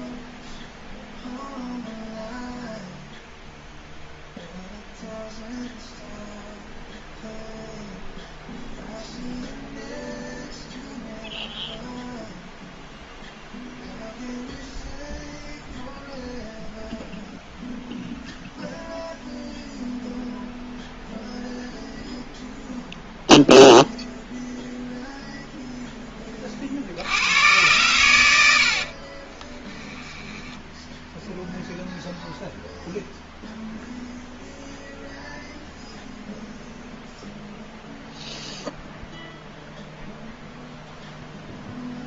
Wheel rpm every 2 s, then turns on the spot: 0, 0, 0, 0, 0, 0, 0, 0, 0, 0, 0, 0, 0, 60, 70, 0, 0, 0, 0, 0, 0.
28-30